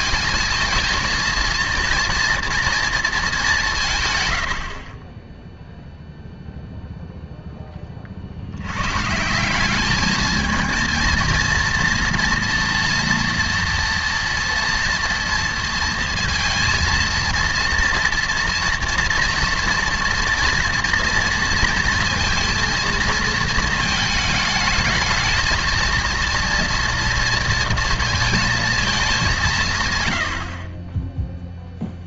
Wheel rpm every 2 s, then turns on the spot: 220, 230, 80, 0, 80, 220, 230, 230, 230, 230, 230, 220, 210, 230, 220, 30.
none